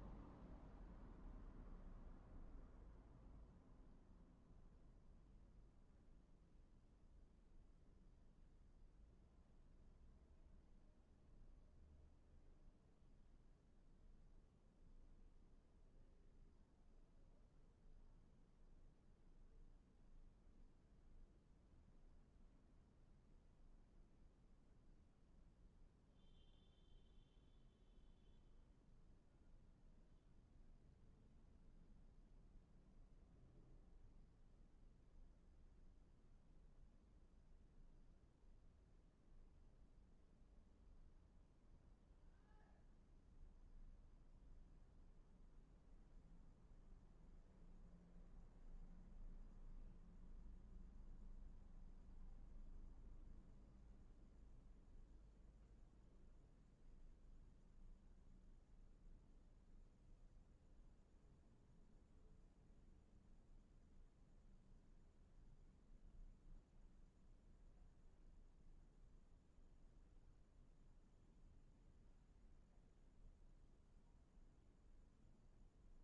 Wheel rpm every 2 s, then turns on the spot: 0, 0, 0, 0, 0, 0, 0, 0, 0, 0, 0, 0, 0, 0, 0, 0, 0, 0, 0, 0, 0, 0, 0, 0, 0, 0, 0, 0, 0, 0, 0, 0, 0, 0, 0, 0, 0, 0.
none